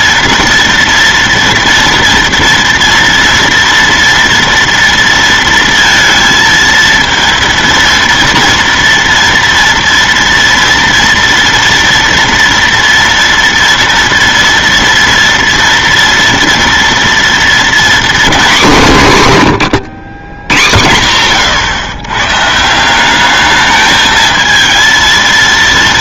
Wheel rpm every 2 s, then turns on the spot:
230, 230, 240, 230, 230, 230, 230, 230, 230, 220, 100, 160, 220.
none